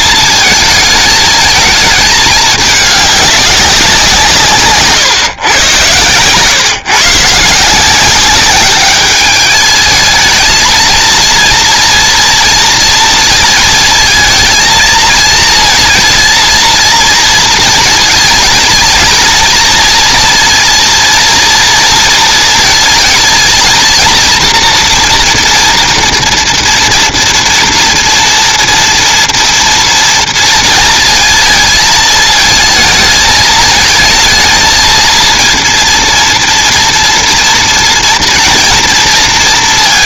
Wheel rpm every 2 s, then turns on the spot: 220, 210, 140, 140, 210, 230, 230, 230, 230, 230, 230, 230, 230, 230, 230, 230, 220, 230, 240, 230.
none